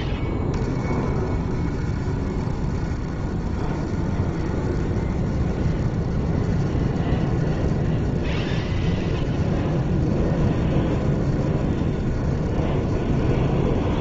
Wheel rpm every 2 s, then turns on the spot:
20, 30, 30, 30, 30, 30, 30.
none